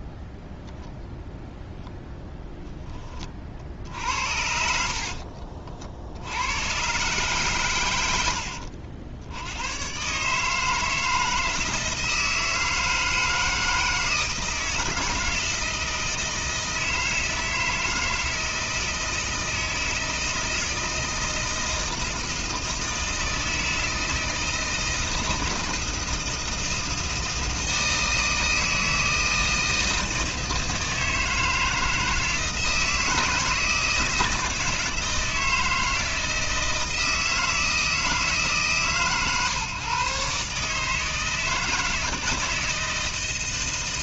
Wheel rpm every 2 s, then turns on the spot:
0, 10, 60, 110, 70, 160, 160, 160, 160, 160, 160, 160, 160, 160, 160, 160, 160, 160, 160, 150, 150, 160.
4-6